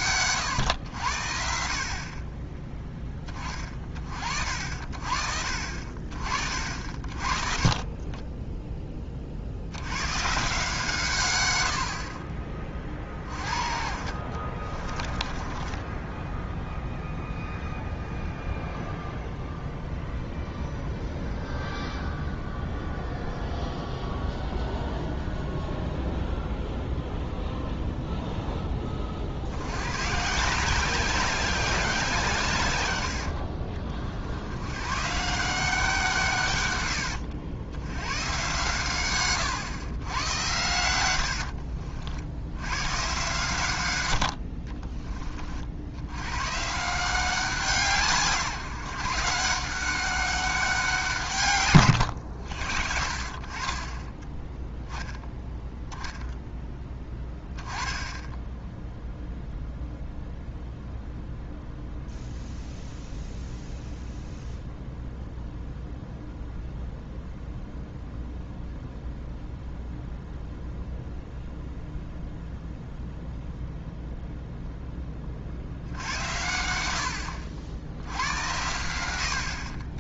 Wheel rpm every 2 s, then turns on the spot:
120, 20, 40, 40, 10, 140, 30, 40, 0, 0, 0, 0, 0, 0, 10, 170, 120, 100, 120, 120, 100, 100, 40, 140, 150, 190, 60, 10, 10, 0, 0, 0, 0, 0, 0, 0, 0, 0, 80, 90.
14-16 44-46